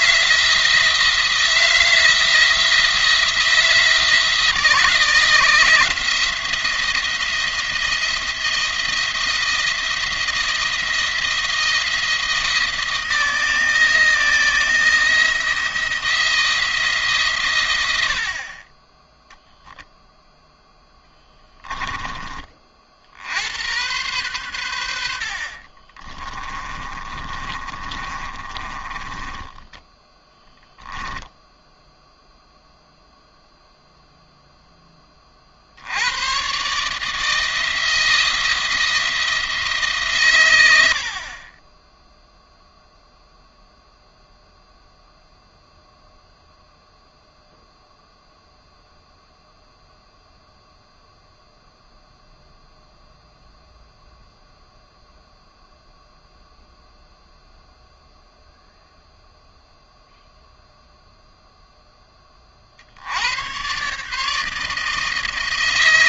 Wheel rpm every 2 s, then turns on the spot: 160, 170, 170, 170, 170, 170, 160, 170, 160, 20, 10, 60, 80, 20, 20, 10, 0, 10, 140, 170, 80, 0, 0, 0, 0, 0, 0, 0, 0, 0, 0, 60, 160.
26-32